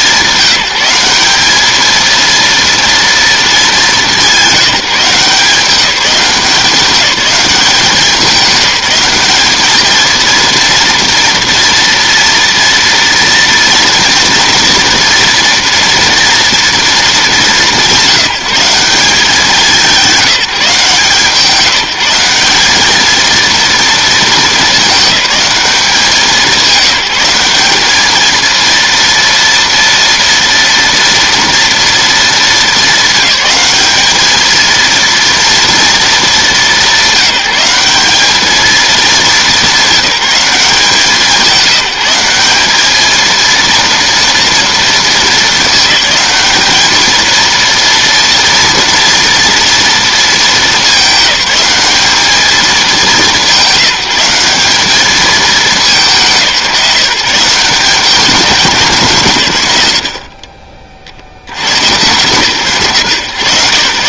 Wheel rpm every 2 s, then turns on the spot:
190, 230, 180, 190, 200, 230, 230, 230, 230, 190, 160, 210, 210, 190, 230, 230, 220, 230, 200, 210, 180, 200, 230, 210, 230, 220, 210, 180, 170, 170, 30, 120.
none